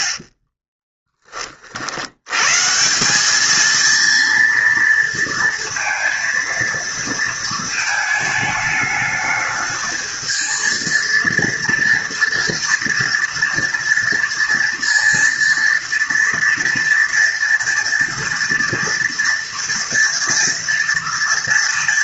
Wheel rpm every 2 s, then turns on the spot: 30, 200, 230, 230, 210, 230, 230, 230, 230, 230, 230.
none